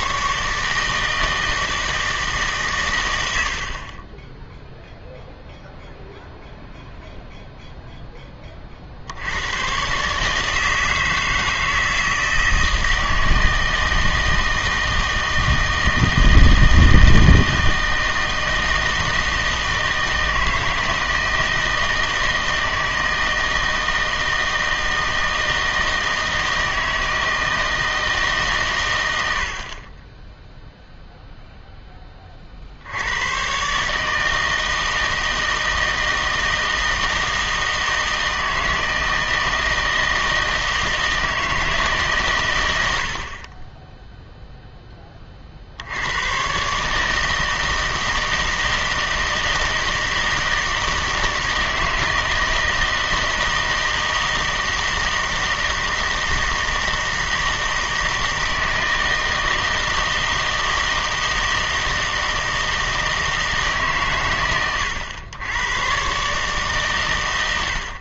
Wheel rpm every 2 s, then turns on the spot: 150, 130, 0, 0, 40, 160, 160, 160, 160, 160, 160, 160, 160, 160, 130, 0, 60, 160, 160, 160, 160, 90, 10, 140, 160, 160, 160, 160, 160, 160, 160, 160, 110, 140.
none